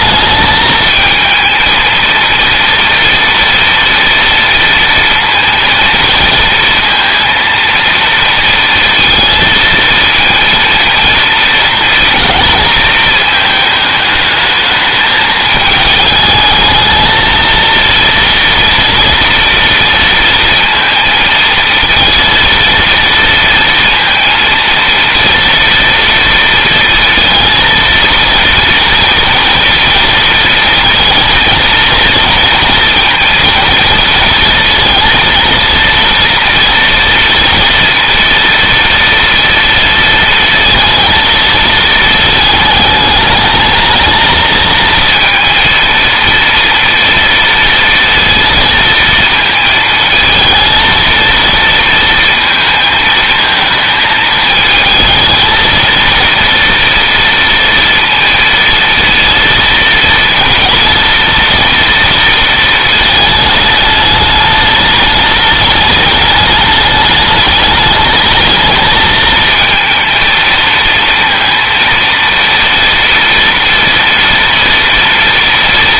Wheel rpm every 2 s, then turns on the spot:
220, 230, 230, 230, 230, 230, 220, 220, 220, 240, 230, 230, 230, 230, 230, 220, 230, 220, 240, 230, 230, 210, 230, 230, 230, 230, 230, 220, 230, 230, 230, 220, 210, 210, 220, 230, 230, 230.
none